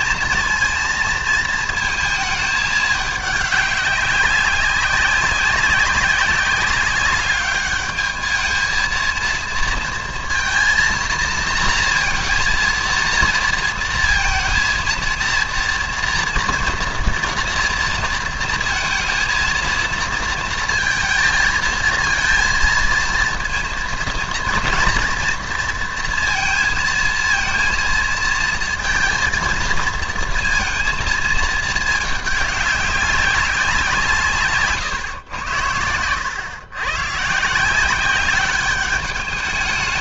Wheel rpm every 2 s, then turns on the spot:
230, 210, 190, 200, 220, 230, 230, 230, 230, 230, 230, 230, 230, 230, 230, 230, 200, 140, 120, 200.
none